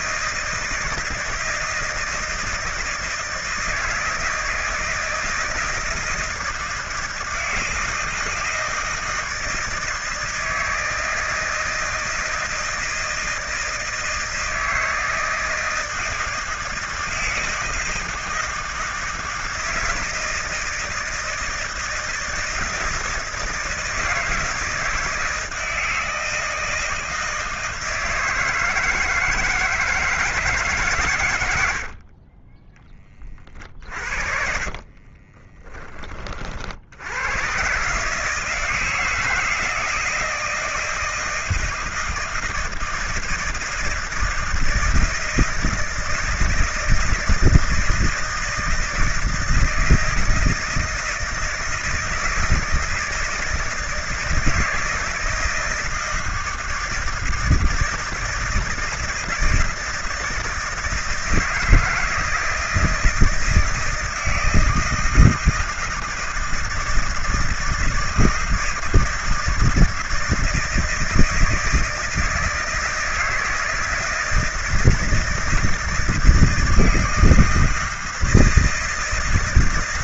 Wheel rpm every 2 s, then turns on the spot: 160, 160, 160, 160, 160, 160, 160, 160, 160, 170, 170, 160, 160, 160, 160, 150, 30, 50, 50, 160, 170, 160, 160, 160, 160, 160, 160, 160, 160, 160, 160, 160, 160, 160, 160, 160, 160, 160, 170, 160.
32-36